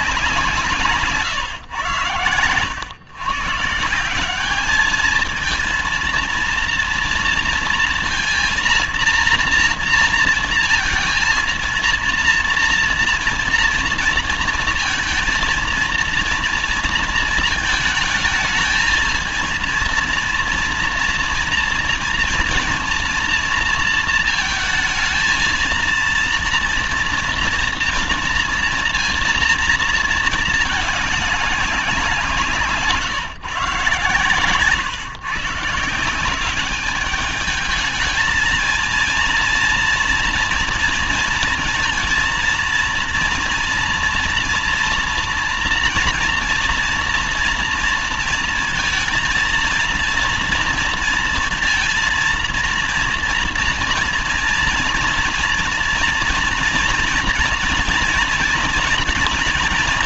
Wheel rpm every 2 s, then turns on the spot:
170, 100, 200, 230, 230, 230, 230, 230, 230, 220, 230, 230, 230, 230, 230, 220, 170, 120, 190, 220, 230, 230, 230, 230, 230, 230, 230, 230, 230, 230.
none